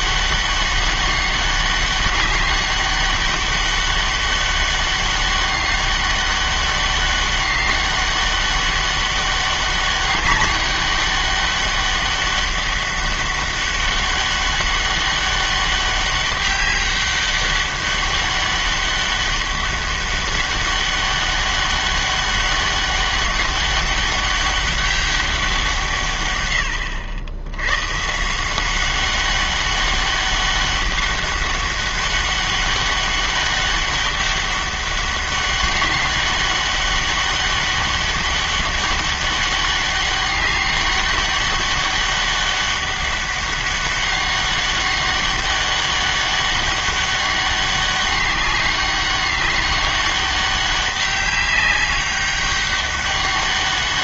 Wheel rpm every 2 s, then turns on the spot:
200, 200, 200, 200, 200, 200, 200, 200, 200, 200, 200, 200, 200, 110, 180, 200, 200, 200, 200, 200, 200, 200, 200, 200, 200, 200, 200.
none